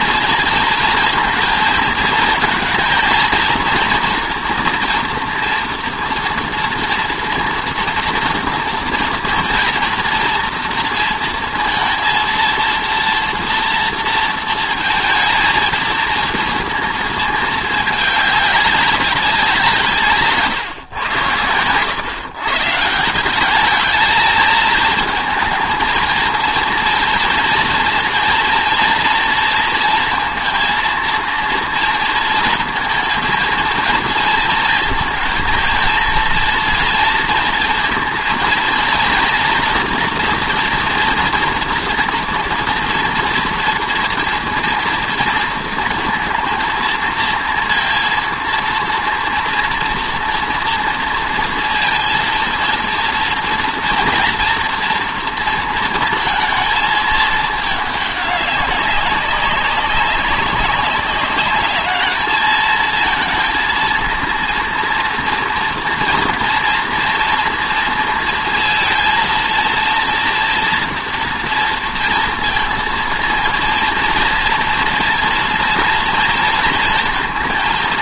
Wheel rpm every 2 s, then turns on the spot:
230, 230, 240, 230, 230, 230, 230, 230, 230, 200, 140, 140, 220, 230, 230, 230, 230, 230, 230, 230, 240, 230, 230, 230, 230, 230, 230, 230, 220, 200, 200, 220, 230, 230, 230, 240, 230, 230, 230.
none